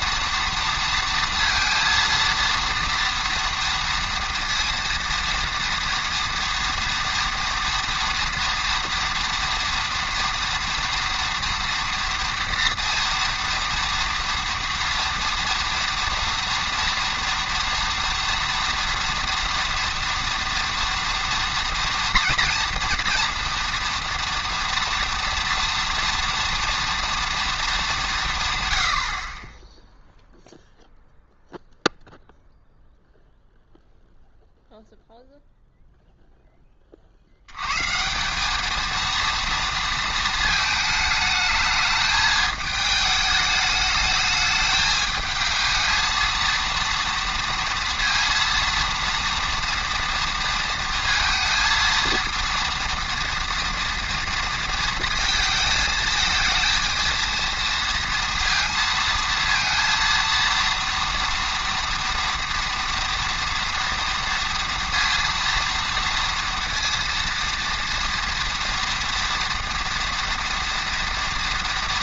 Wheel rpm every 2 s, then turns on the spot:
230, 230, 230, 230, 230, 230, 240, 230, 230, 230, 230, 230, 230, 230, 130, 0, 0, 0, 20, 210, 220, 220, 210, 230, 230, 230, 230, 230, 220, 230, 230, 230, 230, 230, 230, 230.
none